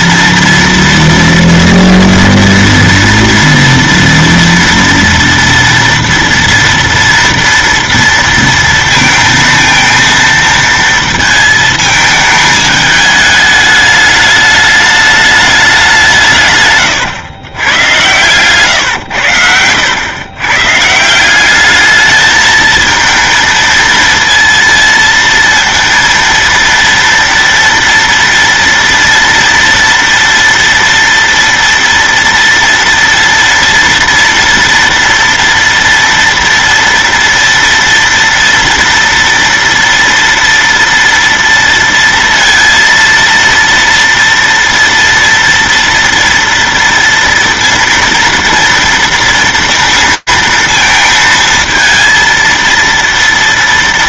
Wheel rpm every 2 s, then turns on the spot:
230, 230, 230, 230, 230, 230, 220, 210, 180, 120, 120, 210, 230, 230, 230, 230, 230, 230, 230, 230, 230, 230, 230, 230, 230, 230, 230.
none